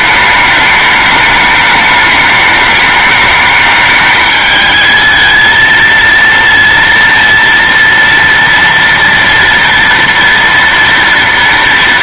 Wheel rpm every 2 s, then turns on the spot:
210, 210, 220, 230, 230, 240.
none